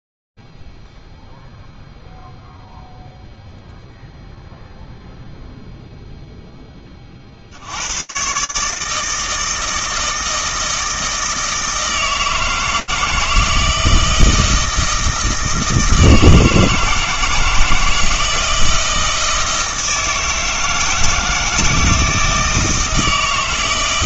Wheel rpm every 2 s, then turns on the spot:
0, 0, 0, 0, 140, 160, 160, 160, 160, 160, 160, 160.
none